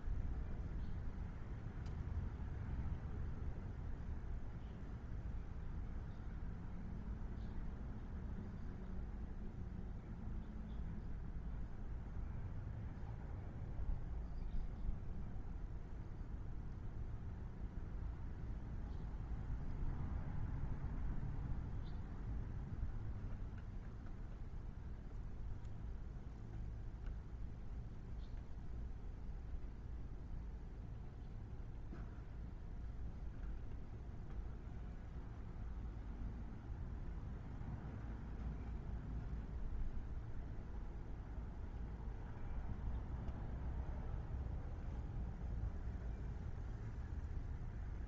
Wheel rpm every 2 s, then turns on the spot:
0, 0, 0, 0, 0, 0, 0, 0, 0, 0, 0, 0, 0, 0, 0, 0, 0, 0, 0, 0, 0, 0, 0, 0.
none